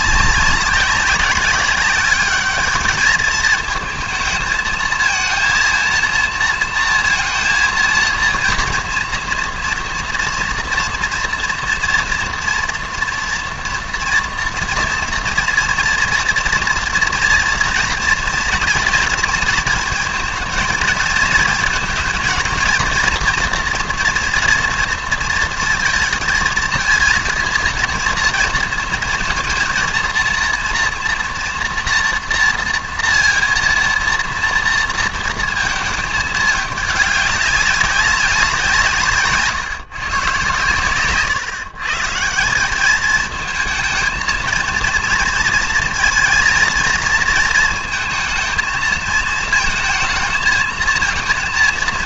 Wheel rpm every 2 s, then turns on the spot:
190, 200, 220, 230, 230, 240, 230, 230, 230, 240, 230, 230, 230, 220, 230, 230, 230, 230, 210, 180, 120, 180, 230, 220, 220, 220.
none